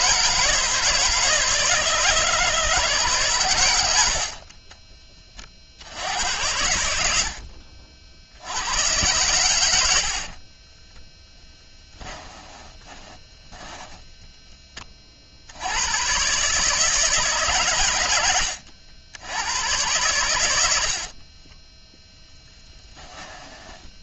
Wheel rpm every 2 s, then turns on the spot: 160, 150, 30, 80, 100, 10, 20, 30, 150, 80, 60, 10.
10-14 20-22